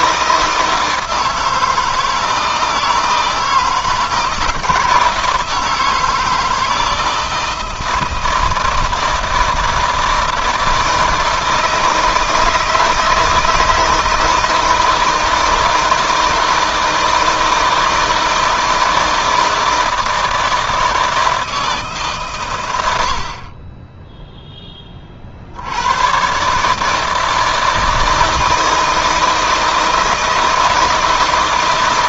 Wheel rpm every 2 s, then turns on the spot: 160, 160, 160, 160, 160, 160, 160, 160, 160, 160, 160, 90, 40, 160, 160, 160.
none